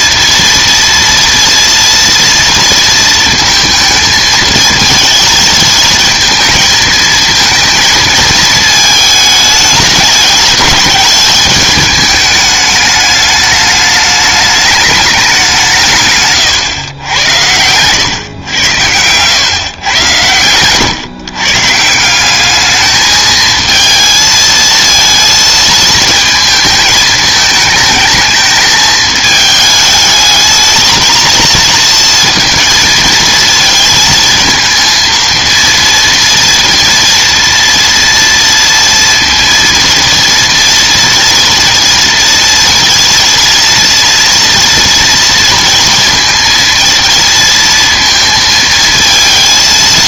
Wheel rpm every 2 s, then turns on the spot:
230, 230, 220, 230, 220, 210, 210, 210, 130, 100, 110, 210, 230, 220, 220, 220, 230, 220, 230, 230, 230, 230, 230, 230, 220.
16-18